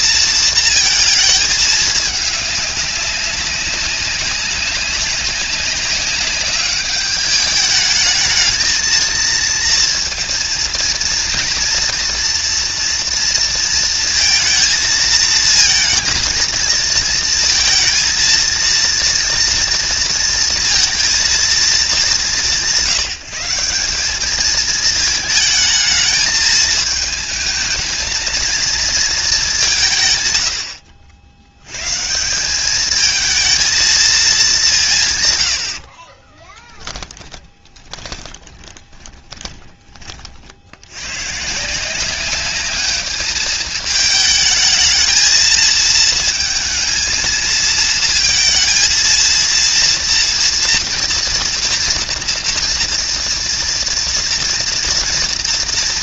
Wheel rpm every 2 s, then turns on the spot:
230, 200, 200, 200, 220, 230, 230, 230, 220, 230, 230, 190, 220, 220, 230, 90, 200, 180, 10, 20, 60, 200, 220, 230, 230, 230, 240, 230.
36-40